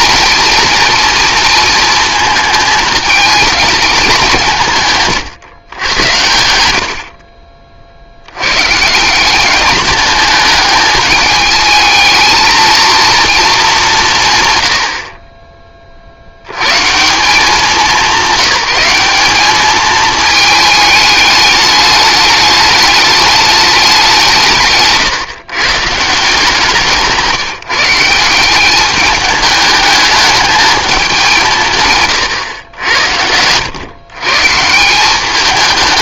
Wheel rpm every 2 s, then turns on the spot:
230, 220, 150, 70, 150, 210, 230, 80, 150, 200, 210, 210, 140, 160, 200, 210, 90, 180.
none